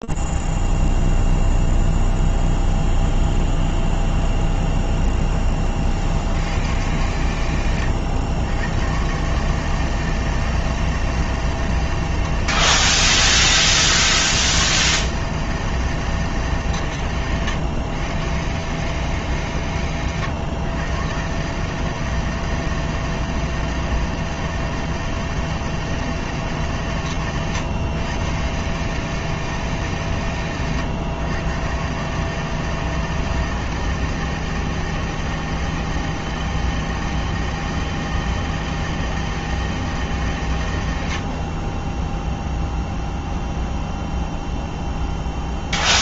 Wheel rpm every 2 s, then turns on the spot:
0, 0, 0, 30, 100, 150, 160, 80, 160, 120, 120, 160, 160, 140, 130, 120, 150, 160, 160, 160, 120, 0, 0.
none